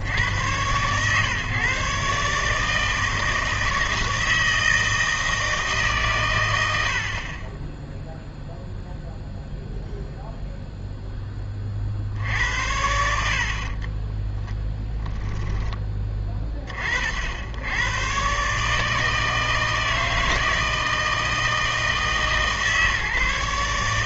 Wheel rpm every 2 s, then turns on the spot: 120, 150, 160, 80, 0, 0, 70, 10, 30, 150, 160, 140.
14-16